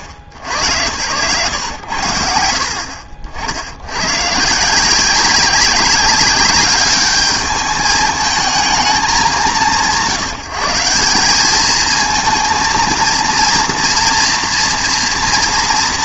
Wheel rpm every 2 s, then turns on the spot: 80, 50, 160, 200, 210, 170, 230, 230.
none